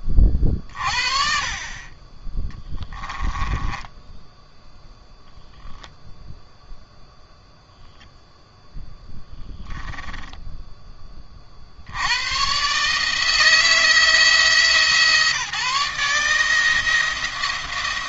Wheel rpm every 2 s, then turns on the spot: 40, 10, 20, 0, 0, 10, 140, 160, 160.
2-4